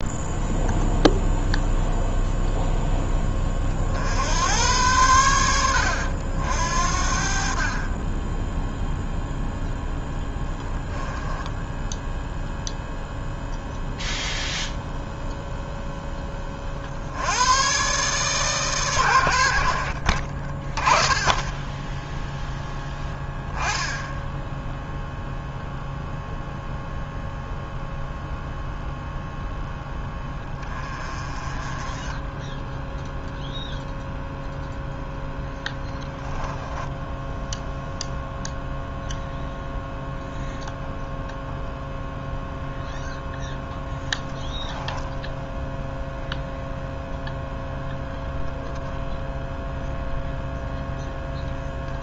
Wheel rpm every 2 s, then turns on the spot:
0, 0, 110, 70, 0, 10, 0, 0, 60, 120, 20, 10, 0, 0, 0, 30, 0, 0, 10, 0, 0, 0, 0, 0, 0, 0.
10-12 36-38